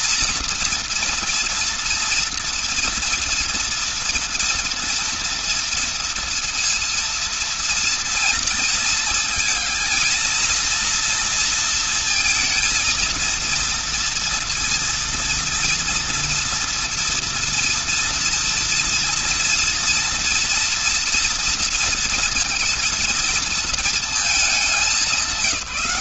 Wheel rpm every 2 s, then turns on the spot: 230, 230, 230, 230, 230, 230, 230, 230, 230, 230, 230, 230, 190.
none